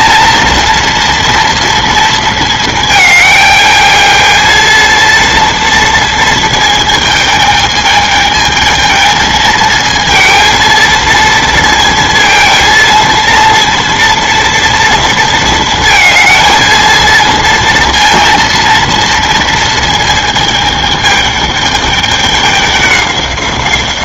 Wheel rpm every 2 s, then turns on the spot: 240, 220, 230, 220, 220, 230, 230, 230, 220, 230, 220, 200.
none